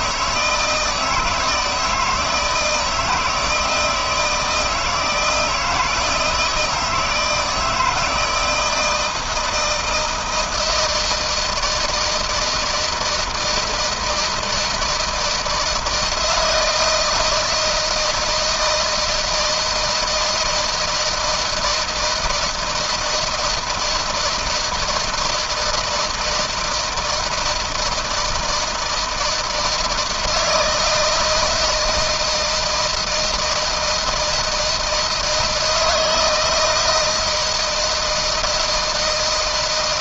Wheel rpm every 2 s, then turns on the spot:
160, 160, 160, 160, 170, 170, 160, 160, 160, 160, 160, 160, 160, 160, 160, 160, 160, 160, 160, 160.
none